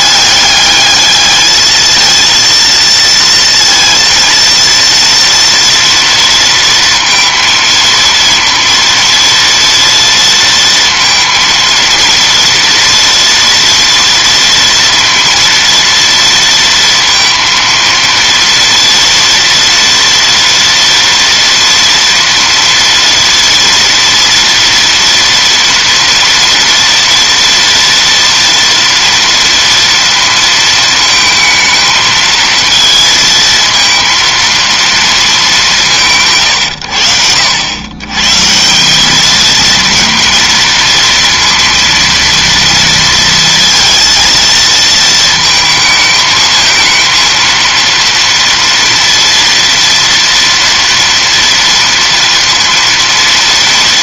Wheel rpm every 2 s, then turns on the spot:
210, 230, 230, 230, 230, 230, 230, 230, 230, 230, 230, 230, 230, 230, 230, 220, 230, 220, 100, 190, 230, 230, 230, 220, 230, 240, 230.
none